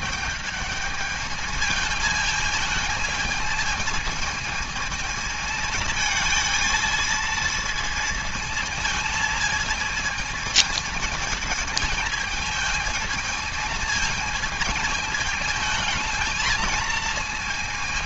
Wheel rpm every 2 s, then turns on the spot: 210, 220, 220, 220, 220, 220, 220, 220, 220.
none